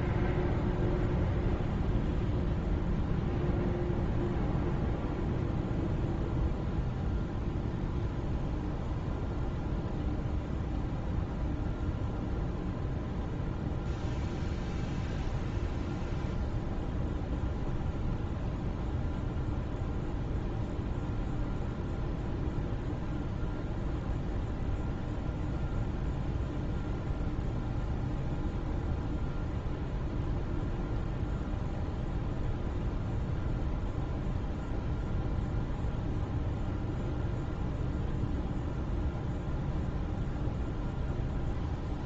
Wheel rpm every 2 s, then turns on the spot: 0, 0, 0, 0, 0, 0, 0, 0, 0, 0, 0, 0, 0, 0, 0, 0, 0, 0, 0, 0, 0.
none